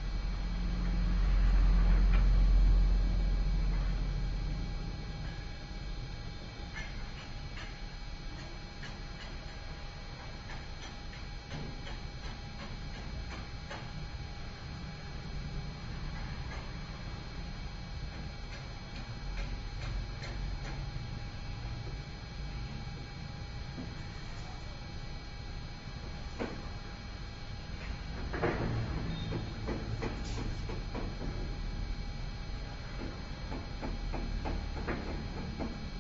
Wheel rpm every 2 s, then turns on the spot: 0, 0, 0, 0, 0, 0, 0, 0, 0, 0, 0, 0, 0, 0, 0, 0, 0, 0.
none